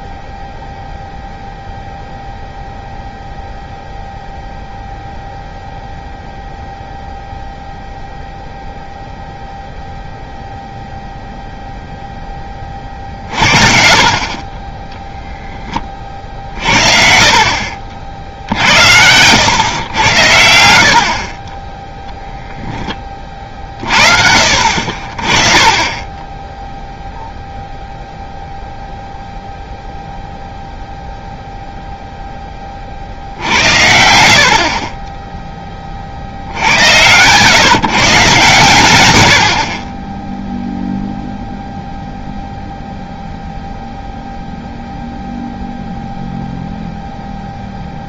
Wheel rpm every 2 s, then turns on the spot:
0, 0, 0, 0, 0, 0, 30, 20, 50, 80, 60, 10, 50, 0, 0, 0, 40, 40, 90, 130, 0, 0, 0, 0.
none